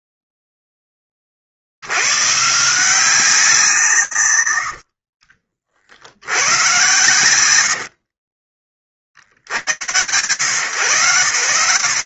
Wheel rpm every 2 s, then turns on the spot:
10, 160, 70, 110, 20, 110.
4-6